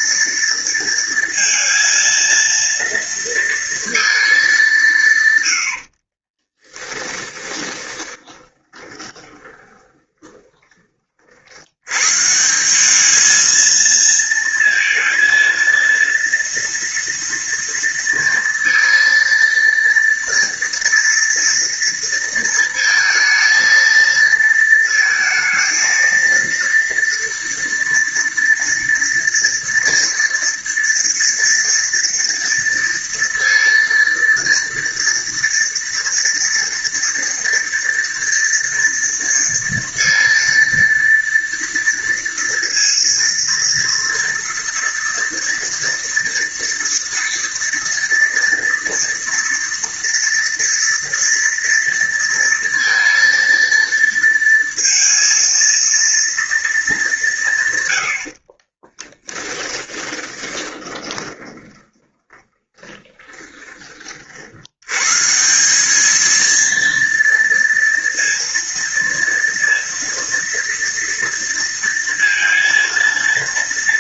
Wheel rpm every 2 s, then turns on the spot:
230, 230, 150, 10, 20, 40, 210, 230, 230, 230, 230, 220, 220, 230, 230, 230, 230, 230, 230, 230, 230, 230, 230, 230, 230, 230, 230, 230, 200, 30, 20, 20, 130, 230, 230, 230, 230.
6-10 58-64